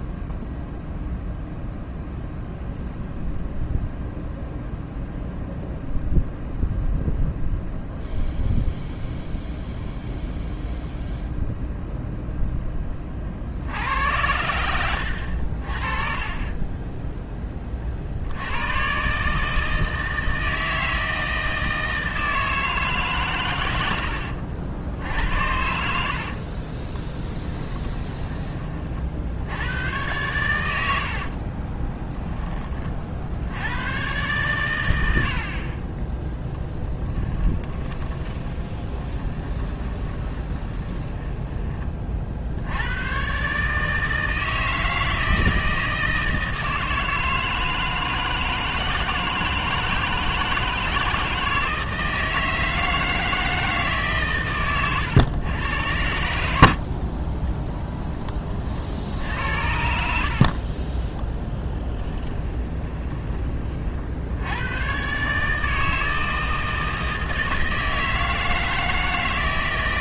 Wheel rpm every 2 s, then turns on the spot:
0, 0, 0, 0, 0, 0, 20, 80, 10, 110, 160, 150, 70, 20, 30, 90, 40, 100, 20, 20, 20, 90, 160, 160, 160, 160, 160, 110, 50, 50, 40, 30, 120, 160, 160.
16-18 26-28 36-42 60-64